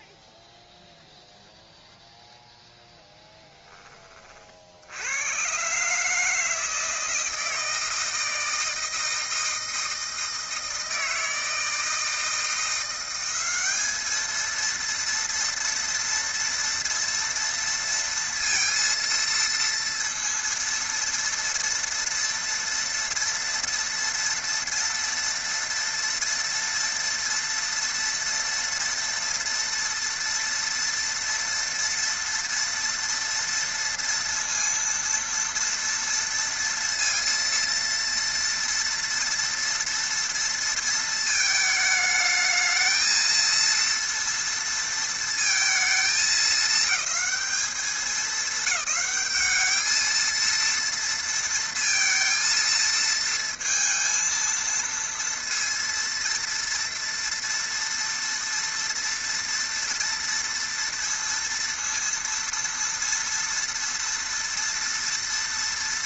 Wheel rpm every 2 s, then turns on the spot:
0, 0, 50, 160, 160, 160, 170, 230, 230, 230, 230, 230, 230, 230, 230, 230, 230, 230, 230, 230, 230, 220, 230, 220, 200, 230, 230, 230, 230, 230, 230, 230, 230.
none